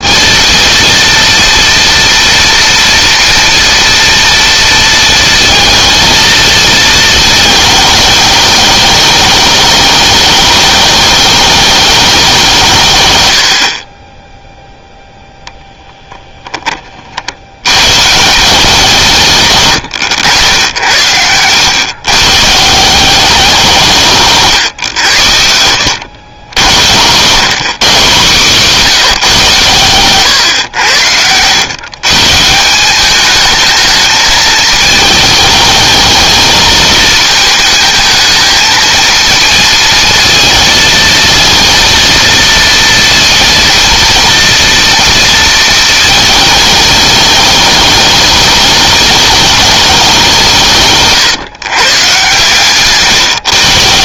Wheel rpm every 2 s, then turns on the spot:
230, 230, 230, 220, 210, 210, 130, 0, 40, 170, 90, 180, 110, 110, 180, 100, 190, 210, 220, 230, 220, 240, 230, 210, 210, 150, 140.
20-22 30-32 50-52